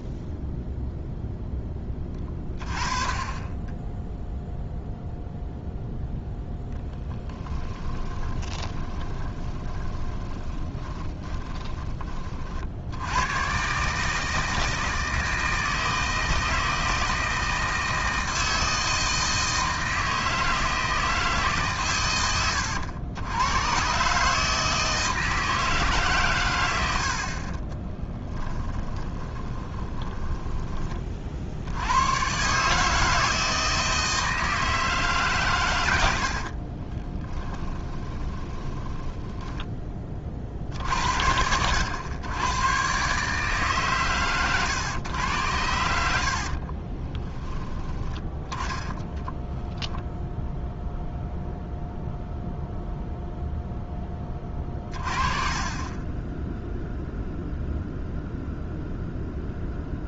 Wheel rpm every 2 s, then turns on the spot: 0, 20, 0, 0, 20, 20, 70, 160, 160, 160, 160, 100, 160, 80, 10, 20, 150, 160, 20, 10, 60, 120, 120, 30, 20, 0, 0, 30, 0, 0.
8-12 28-30 36-40 46-50